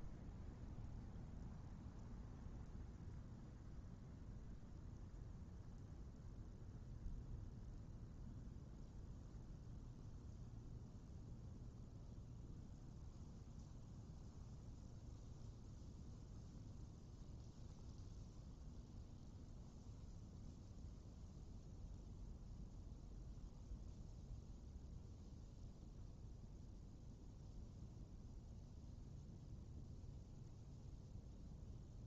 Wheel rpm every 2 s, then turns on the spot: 0, 0, 0, 0, 0, 0, 0, 0, 0, 0, 0, 0, 0, 0, 0, 0.
none